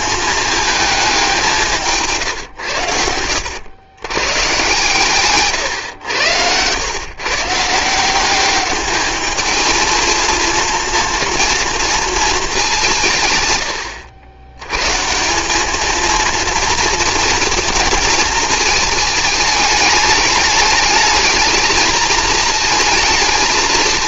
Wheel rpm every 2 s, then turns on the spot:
220, 110, 140, 110, 200, 230, 200, 110, 230, 220, 220, 220.
none